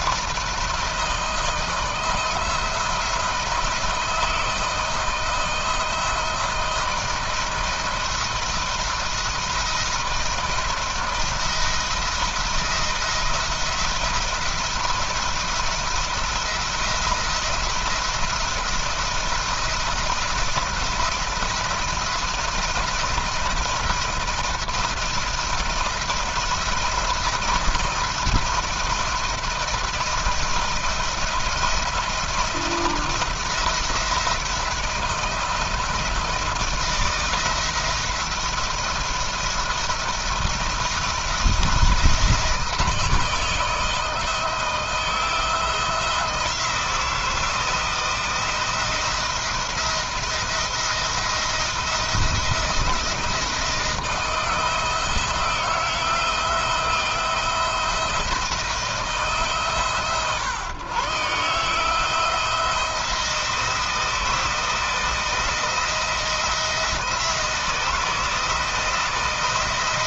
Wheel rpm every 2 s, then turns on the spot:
160, 170, 160, 160, 170, 160, 170, 170, 170, 170, 170, 170, 170, 170, 170, 170, 170, 170, 170, 170, 170, 160, 160, 170, 170, 170, 170, 170, 170, 160, 140, 170, 170, 170, 160.
none